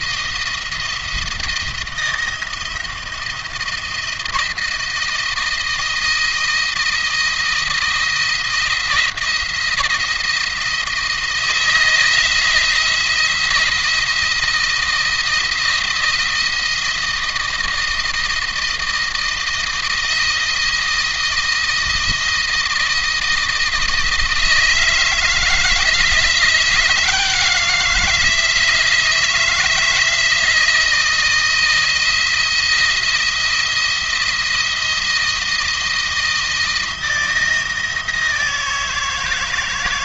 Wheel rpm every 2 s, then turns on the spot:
170, 160, 160, 170, 170, 170, 160, 170, 170, 170, 160, 160, 160, 170, 170, 160, 170, 170, 160, 160.
none